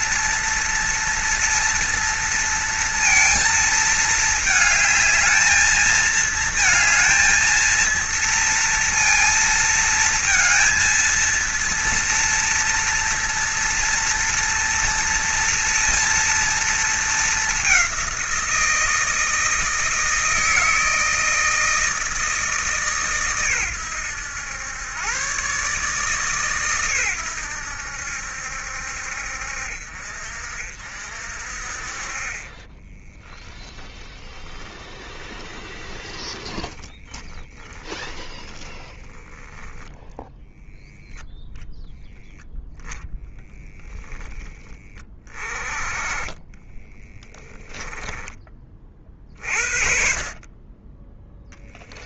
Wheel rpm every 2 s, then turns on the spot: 230, 230, 220, 230, 230, 230, 230, 230, 220, 160, 160, 140, 110, 120, 60, 50, 10, 20, 10, 10, 0, 0, 20, 10, 40, 20.
32-40 46-48